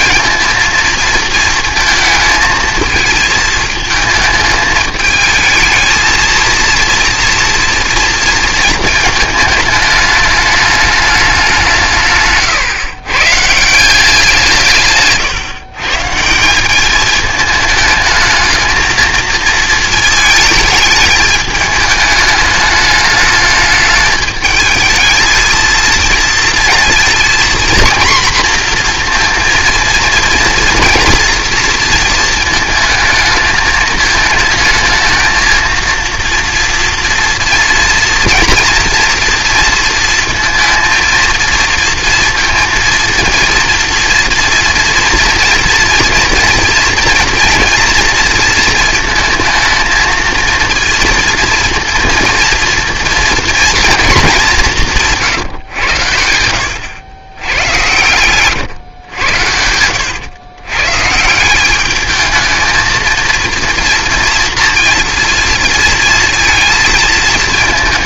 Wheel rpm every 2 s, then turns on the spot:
230, 220, 220, 230, 220, 210, 140, 160, 190, 220, 220, 210, 220, 230, 240, 230, 220, 220, 230, 240, 230, 230, 230, 230, 230, 230, 230, 190, 90, 120, 120, 220, 230, 230.
12-14 58-60